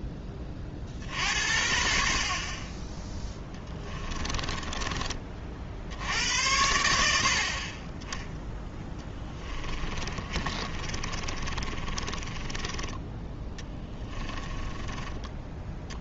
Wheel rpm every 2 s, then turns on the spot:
30, 30, 20, 80, 10, 30, 20, 10.
4-6 10-16